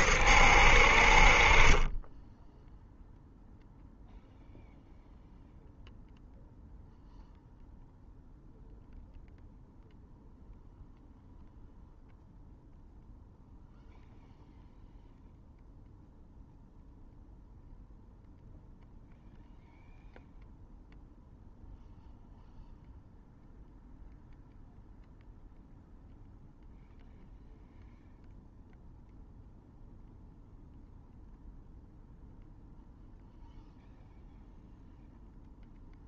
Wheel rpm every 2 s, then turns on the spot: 50, 0, 0, 0, 0, 0, 0, 0, 0, 0, 0, 0, 0, 0, 0, 0, 0, 0.
none